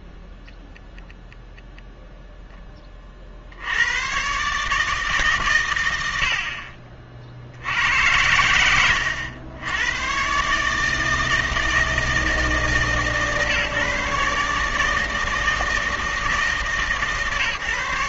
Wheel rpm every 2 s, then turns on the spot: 20, 10, 150, 50, 100, 150, 160, 150, 160.
0-2